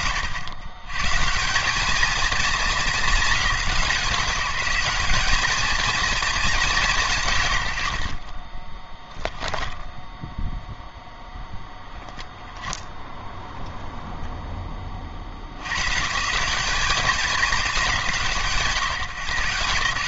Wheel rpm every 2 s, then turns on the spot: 130, 210, 200, 190, 10, 0, 10, 50, 210, 160.
8-10